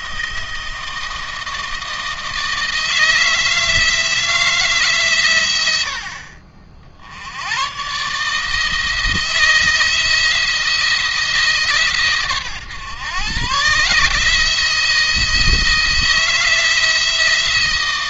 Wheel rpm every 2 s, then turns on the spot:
160, 160, 150, 70, 160, 160, 120, 160, 170.
none